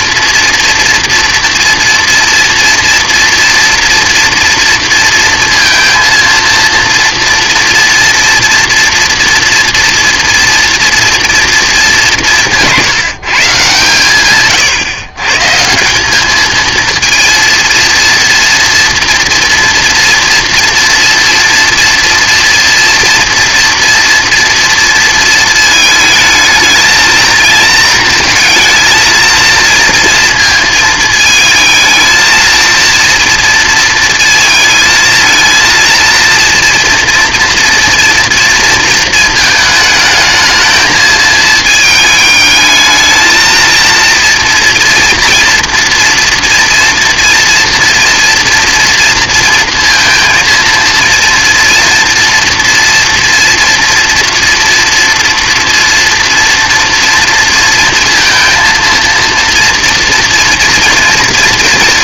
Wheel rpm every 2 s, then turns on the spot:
230, 230, 230, 230, 230, 230, 170, 130, 220, 240, 240, 230, 230, 220, 220, 220, 230, 220, 230, 230, 220, 220, 240, 230, 240, 230, 230, 240, 230, 230, 230.
none